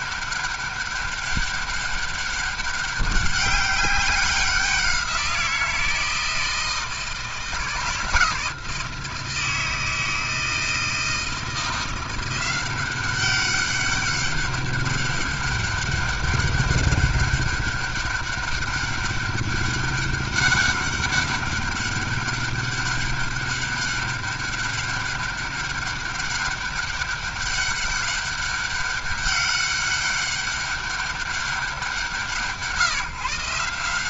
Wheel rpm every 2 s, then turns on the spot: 200, 200, 190, 160, 160, 160, 180, 200, 200, 200, 200, 200, 200, 200, 200, 200, 140.
none